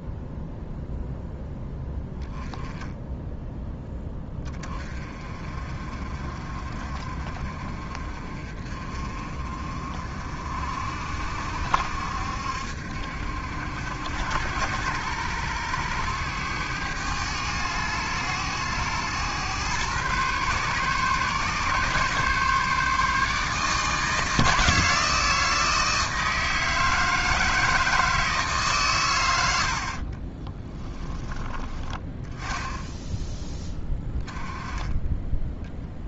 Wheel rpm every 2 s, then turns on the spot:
0, 10, 30, 40, 40, 60, 70, 90, 100, 100, 130, 150, 160, 160, 140, 20, 10, 10.
30-36